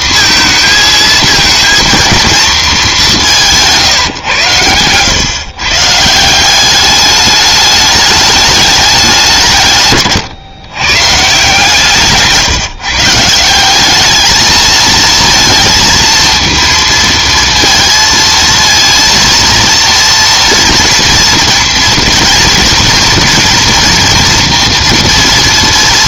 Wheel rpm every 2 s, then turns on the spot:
230, 220, 110, 190, 210, 130, 160, 220, 230, 230, 230, 240, 230.
none